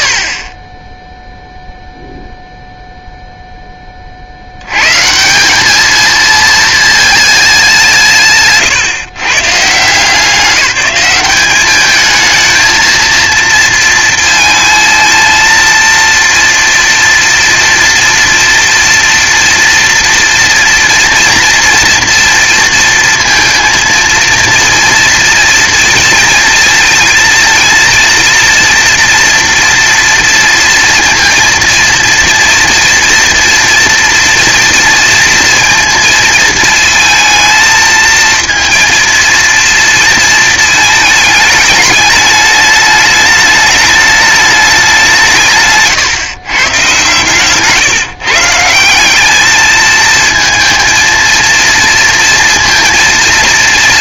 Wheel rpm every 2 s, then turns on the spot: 40, 0, 100, 230, 130, 190, 220, 220, 240, 230, 240, 230, 230, 220, 230, 230, 230, 230, 220, 230, 220, 210, 190, 120, 170, 230, 230.
none